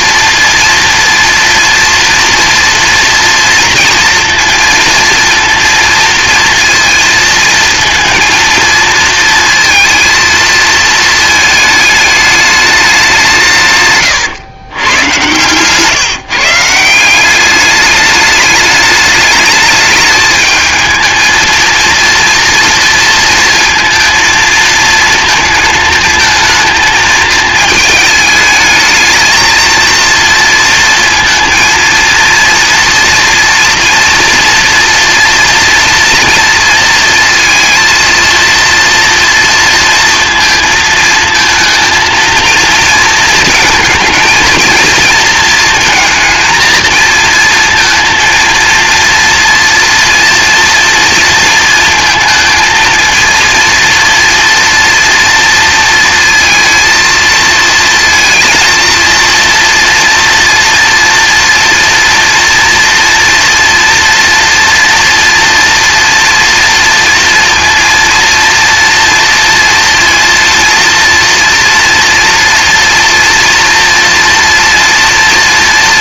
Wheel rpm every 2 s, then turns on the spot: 240, 230, 230, 230, 230, 220, 200, 110, 180, 210, 220, 230, 220, 220, 220, 230, 240, 230, 230, 230, 220, 230, 230, 220, 230, 230, 230, 230, 220, 230, 230, 230, 230, 230, 230, 230, 240, 230.
none